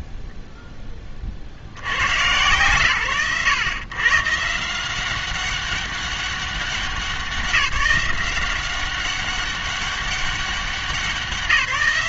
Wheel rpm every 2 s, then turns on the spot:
0, 110, 160, 200, 180, 190.
none